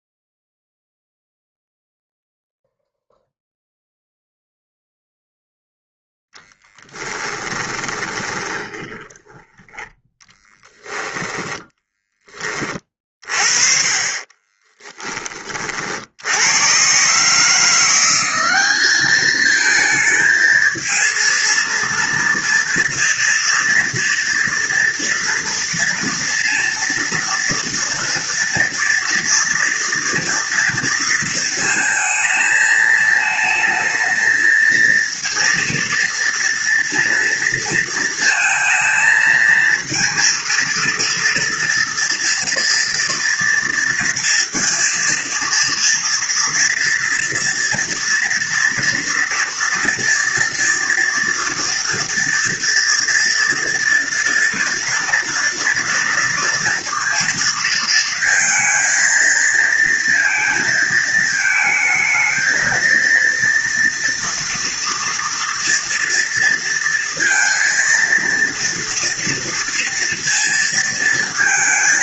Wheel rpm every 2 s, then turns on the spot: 0, 0, 0, 0, 20, 10, 20, 20, 90, 200, 220, 230, 230, 230, 230, 230, 220, 220, 230, 230, 230, 230, 230, 230, 230, 230, 230, 230, 230, 230, 230, 220, 230, 230, 230, 230.
8-12 14-16